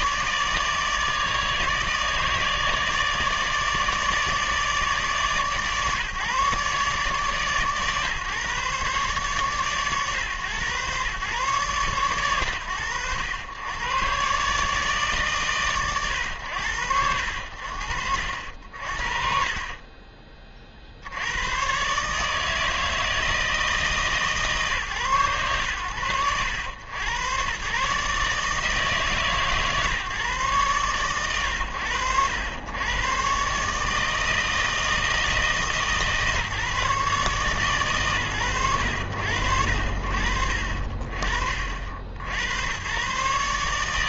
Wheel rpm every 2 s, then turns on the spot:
160, 150, 150, 140, 140, 120, 90, 140, 80, 50, 80, 160, 120, 100, 150, 110, 110, 160, 150, 100, 50, 100.
none